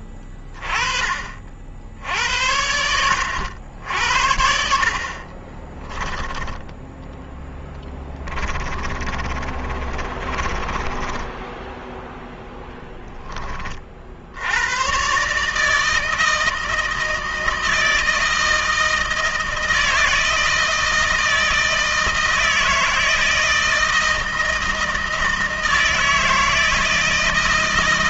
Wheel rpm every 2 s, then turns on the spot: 20, 70, 70, 10, 30, 30, 0, 80, 160, 160, 160, 160, 160, 160.
6-12